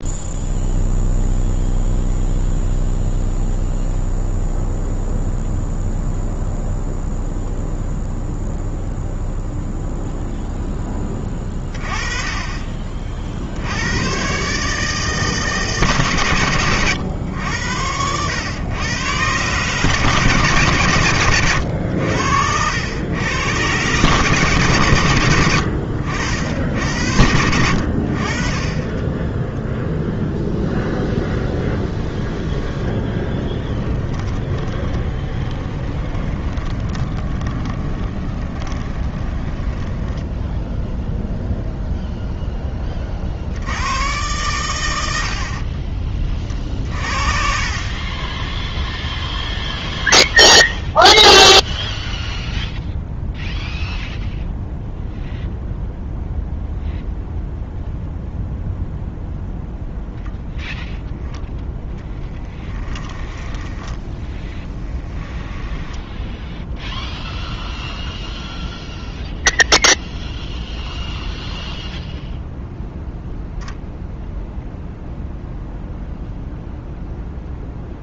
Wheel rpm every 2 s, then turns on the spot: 0, 0, 0, 0, 0, 10, 40, 150, 110, 110, 110, 100, 130, 80, 10, 0, 10, 20, 20, 20, 0, 30, 90, 40, 0, 0, 0, 0, 0, 0, 0, 20, 10, 0, 0, 0, 0, 0, 0.
32-40 62-66